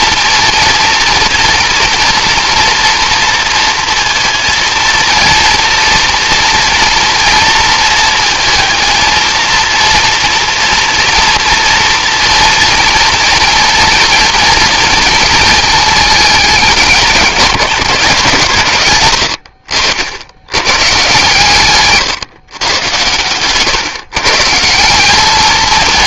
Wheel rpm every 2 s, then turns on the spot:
230, 230, 230, 230, 230, 230, 230, 230, 200, 120, 120, 110, 180.
none